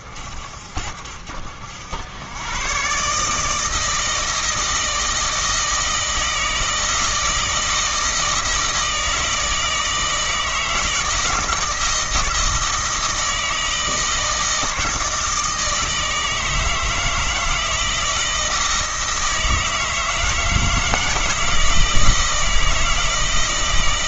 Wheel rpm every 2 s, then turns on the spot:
50, 120, 160, 160, 160, 160, 160, 160, 160, 160, 160, 170.
none